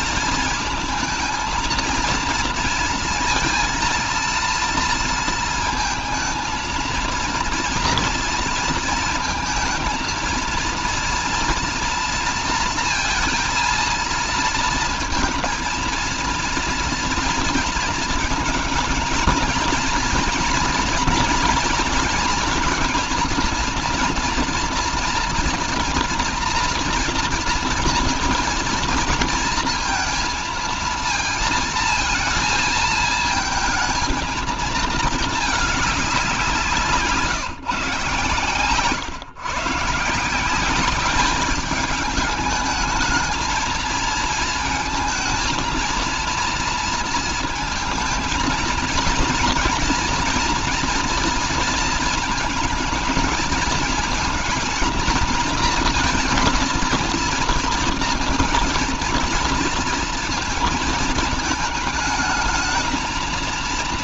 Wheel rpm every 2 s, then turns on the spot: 220, 230, 230, 230, 230, 230, 230, 230, 230, 230, 240, 230, 230, 230, 230, 220, 220, 220, 170, 130, 190, 210, 230, 230, 230, 230, 220, 230, 230, 230, 220, 220.
none